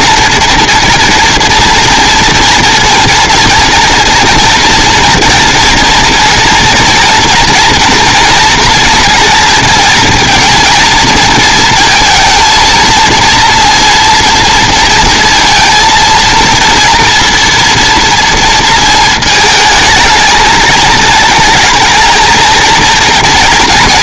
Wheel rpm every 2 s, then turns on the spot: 230, 230, 240, 230, 240, 230, 230, 230, 230, 230, 220, 230.
none